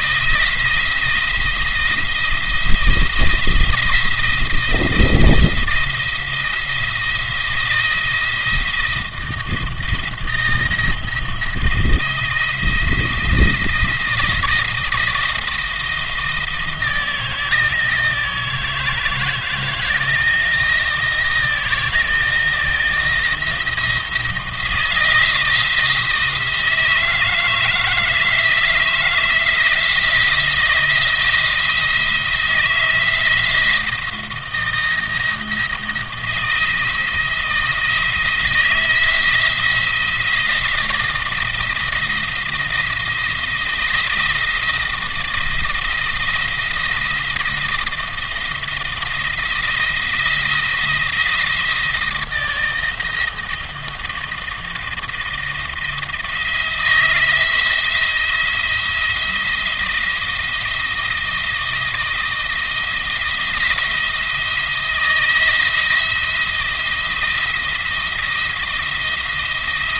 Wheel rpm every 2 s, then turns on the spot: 170, 160, 170, 170, 160, 170, 160, 170, 160, 160, 170, 170, 170, 160, 160, 160, 170, 170, 170, 170, 170, 170, 160, 170, 170, 170, 170, 170, 170, 170, 170, 170, 170, 170, 170.
none